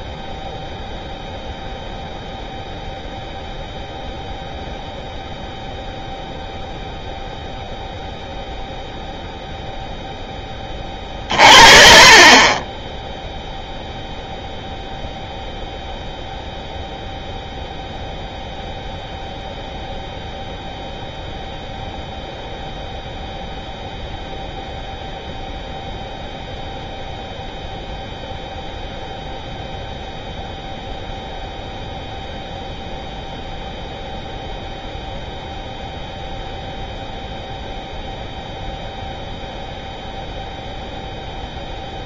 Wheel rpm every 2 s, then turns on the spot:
0, 0, 0, 0, 0, 10, 20, 0, 0, 0, 0, 0, 0, 0, 0, 0, 0, 0, 0, 0, 0.
none